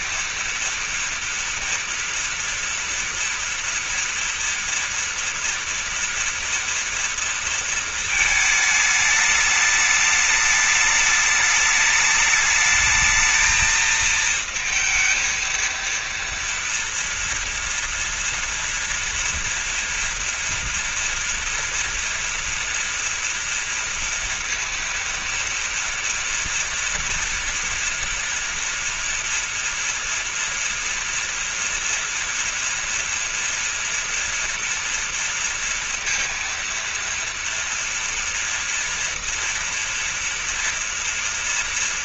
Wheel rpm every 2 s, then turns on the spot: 230, 240, 230, 230, 220, 210, 210, 220, 230, 240, 230, 230, 230, 230, 230, 230, 240, 230, 230, 230, 230.
none